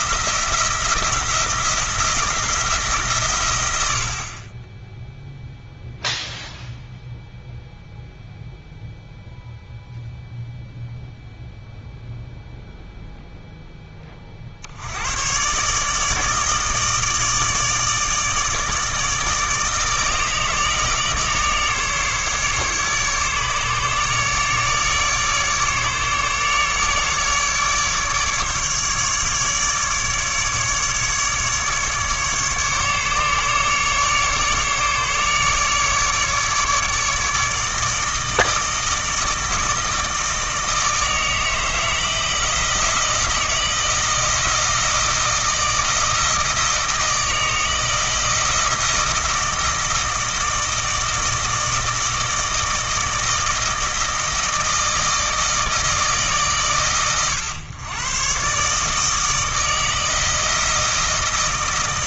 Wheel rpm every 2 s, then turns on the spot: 170, 160, 20, 0, 0, 0, 0, 60, 150, 160, 160, 140, 150, 150, 150, 150, 150, 150, 150, 160, 160, 160, 160, 160, 160, 160, 160, 160, 140, 140, 160.
none